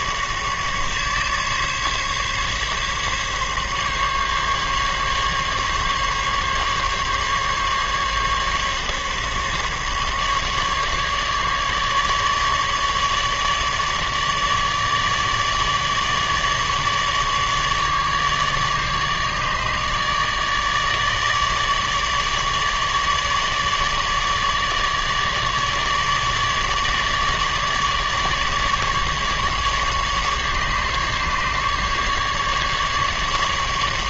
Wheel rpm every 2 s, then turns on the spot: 150, 140, 140, 140, 140, 140, 150, 150, 150, 150, 150, 150, 150, 150, 150, 140, 150.
none